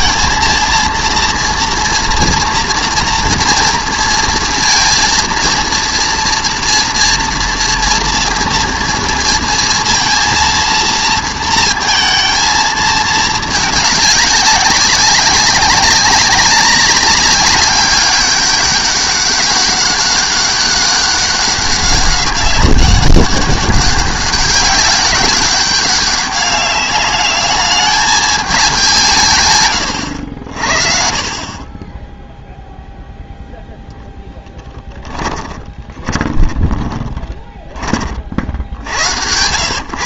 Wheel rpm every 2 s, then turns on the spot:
230, 230, 230, 230, 230, 230, 220, 190, 200, 200, 200, 200, 200, 200, 200, 60, 0, 10, 20, 60.
34-38